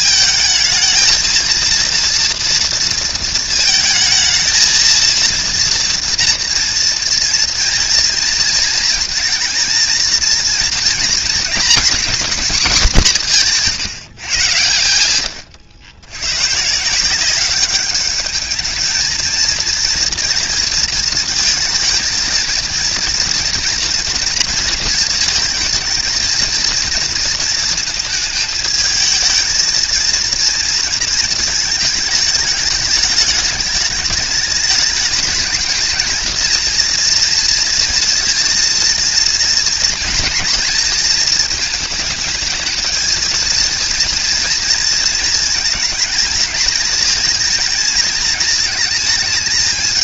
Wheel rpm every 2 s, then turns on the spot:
220, 230, 220, 230, 240, 230, 210, 110, 140, 220, 230, 230, 230, 230, 220, 230, 210, 220, 230, 230, 230, 220, 230, 220, 220.
none